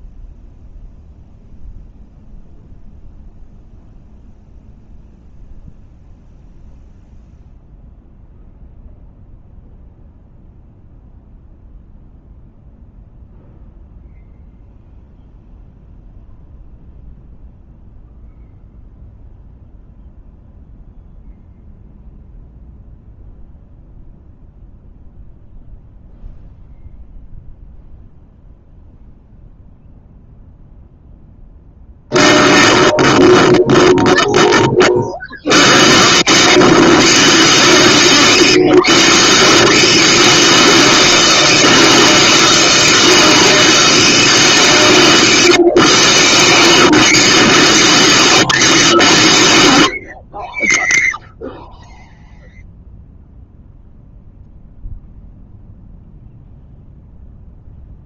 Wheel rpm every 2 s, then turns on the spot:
0, 0, 0, 0, 0, 0, 0, 0, 0, 0, 0, 0, 0, 0, 0, 0, 0, 0, 0, 0, 0, 0, 0, 0, 0, 0, 0, 0, 0.
none